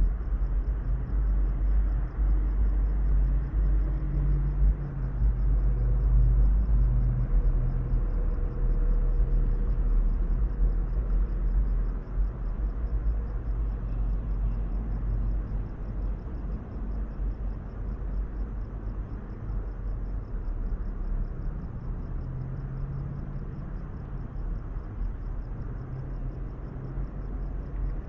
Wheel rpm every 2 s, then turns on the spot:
0, 0, 0, 0, 0, 0, 0, 0, 0, 0, 0, 0, 0, 0.
none